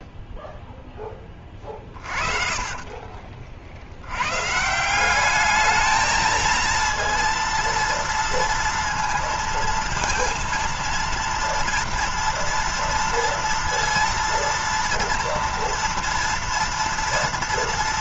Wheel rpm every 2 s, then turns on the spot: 0, 40, 160, 230, 230, 230, 230, 230, 230.
2-4